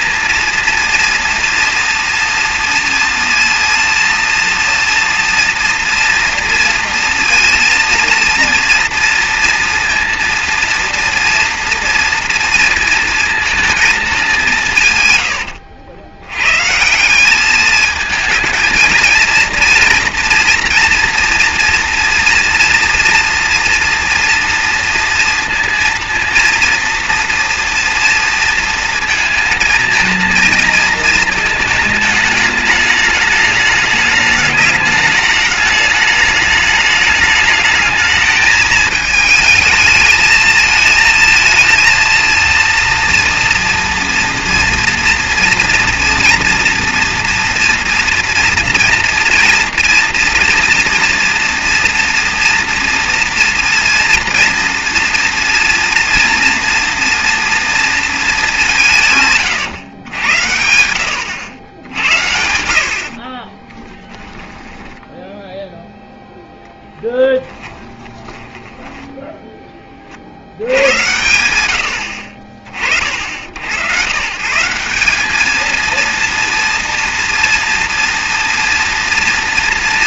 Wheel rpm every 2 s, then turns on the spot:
230, 230, 230, 230, 230, 230, 230, 190, 110, 220, 230, 230, 230, 230, 230, 230, 210, 210, 210, 220, 220, 230, 230, 230, 230, 230, 230, 230, 230, 210, 90, 80, 10, 0, 10, 70, 50, 140, 240, 230.
64-66 68-70